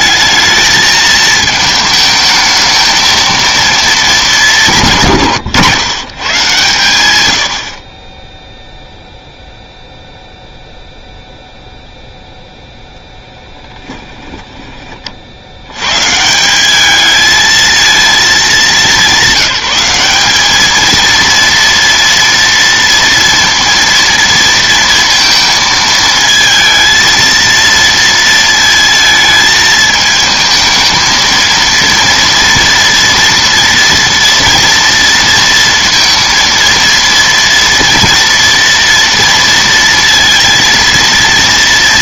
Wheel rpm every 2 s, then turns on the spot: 210, 220, 190, 140, 0, 0, 0, 20, 190, 210, 210, 230, 230, 220, 230, 220, 230, 230, 230, 240, 230.
none